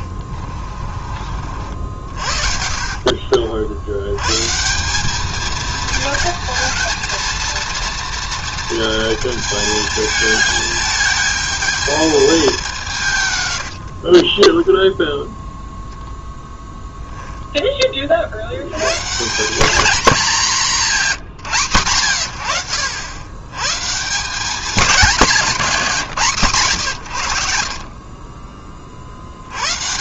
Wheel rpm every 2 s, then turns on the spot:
40, 60, 160, 230, 230, 210, 190, 10, 0, 100, 210, 90, 200, 150, 20.
0-4 14-16